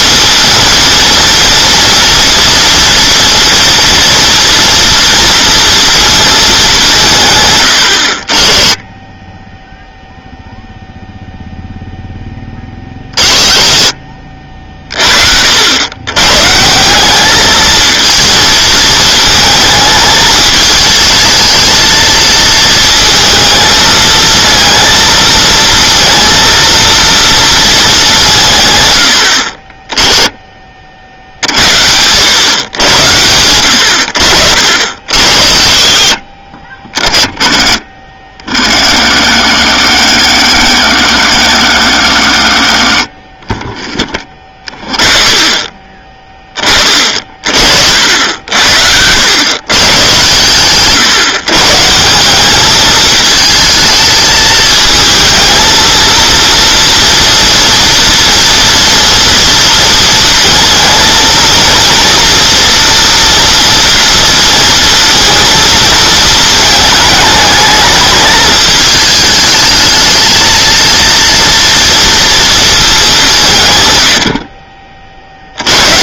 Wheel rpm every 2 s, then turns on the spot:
230, 230, 230, 190, 20, 0, 20, 50, 170, 220, 220, 230, 230, 230, 110, 40, 100, 70, 40, 60, 100, 50, 30, 20, 80, 130, 210, 220, 230, 230, 230, 240, 230, 220, 210, 230, 220, 40.
36-38